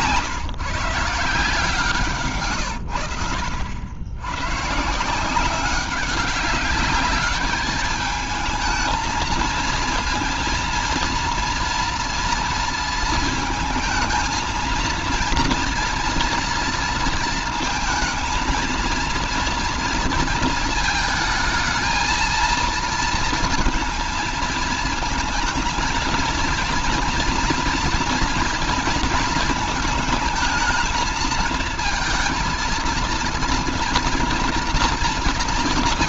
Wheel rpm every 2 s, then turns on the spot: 140, 110, 140, 200, 220, 230, 230, 230, 230, 230, 220, 230, 230, 230, 230, 220, 230, 230.
none